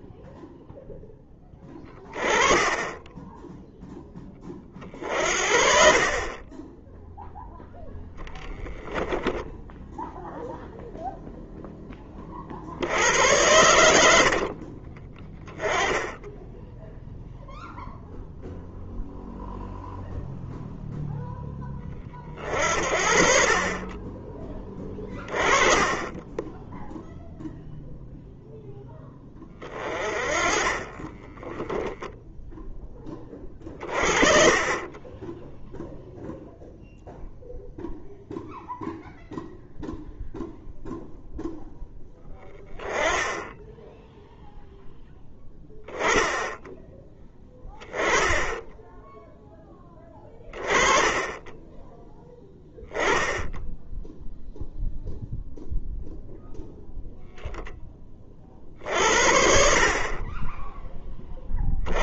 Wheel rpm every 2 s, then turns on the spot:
0, 10, 40, 20, 10, 0, 60, 40, 0, 0, 0, 50, 20, 0, 10, 30, 10, 30, 0, 0, 0, 10, 0, 10, 10, 20, 10, 0, 0, 50, 20.
24-26